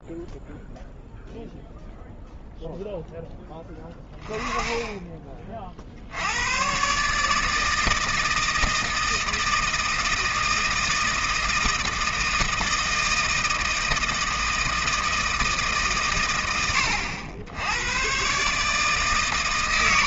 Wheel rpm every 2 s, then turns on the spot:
0, 0, 10, 110, 160, 160, 160, 160, 110, 140.
none